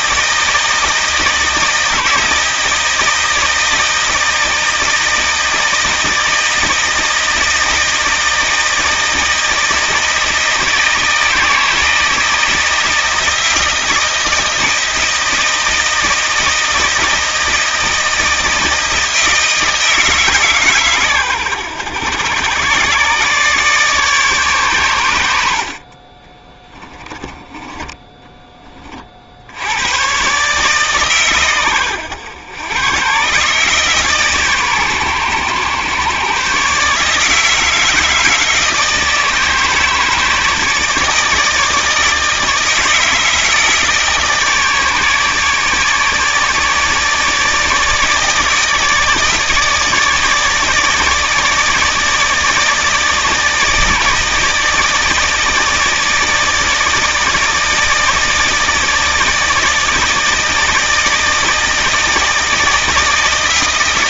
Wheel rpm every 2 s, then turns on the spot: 160, 160, 160, 160, 160, 160, 160, 160, 160, 160, 140, 120, 120, 20, 30, 140, 110, 130, 150, 160, 150, 160, 150, 150, 160, 150, 160, 160, 160, 150, 160, 160.
26-28